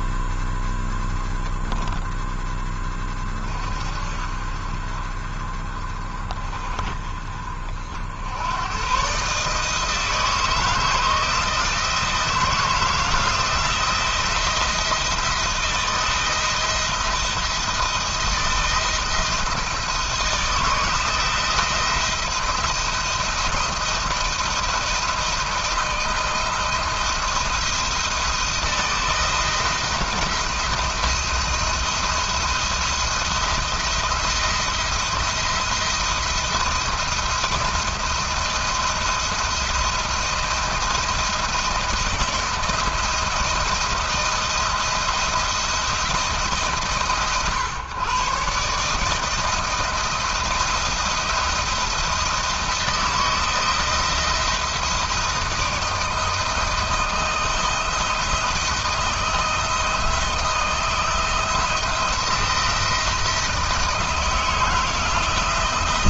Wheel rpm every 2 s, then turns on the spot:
10, 20, 40, 40, 120, 160, 160, 160, 170, 160, 170, 170, 160, 170, 160, 170, 170, 170, 170, 170, 160, 170, 170, 140, 160, 170, 170, 160, 160, 160, 160, 160, 150.
none